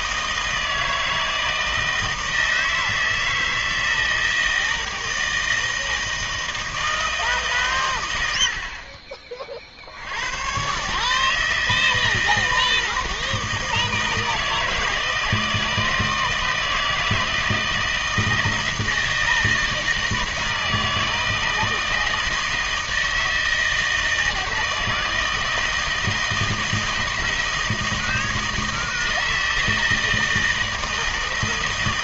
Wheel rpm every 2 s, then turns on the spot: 160, 160, 160, 160, 60, 120, 160, 160, 160, 160, 160, 160, 160, 160, 160, 160.
none